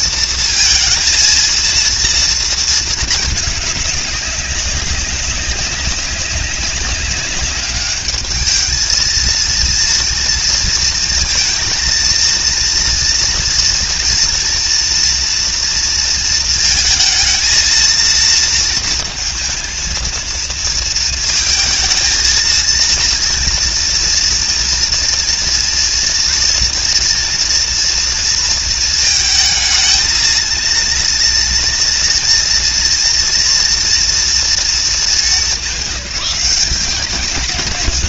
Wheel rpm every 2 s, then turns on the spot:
230, 220, 200, 200, 220, 230, 230, 230, 220, 230, 230, 230, 230, 240, 220, 230, 230, 220, 200.
none